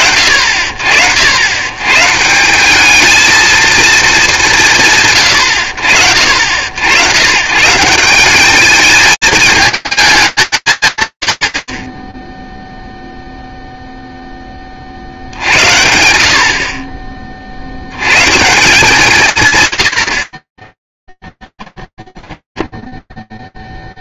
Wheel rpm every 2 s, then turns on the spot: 70, 210, 140, 110, 220, 160, 0, 50, 30, 150, 0, 20.
22-24